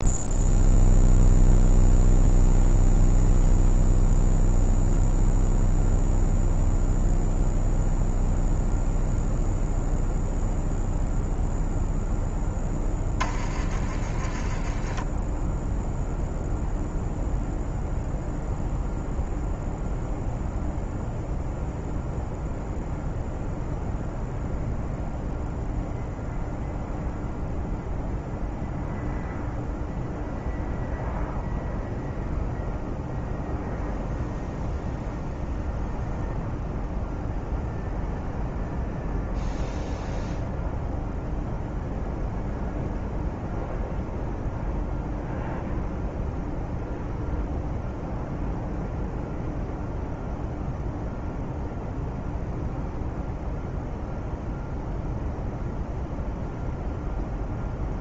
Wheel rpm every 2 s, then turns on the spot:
0, 0, 0, 0, 0, 0, 10, 20, 0, 0, 0, 0, 0, 0, 0, 0, 0, 0, 0, 0, 0, 0, 0, 0, 0, 0, 0, 0, 0.
none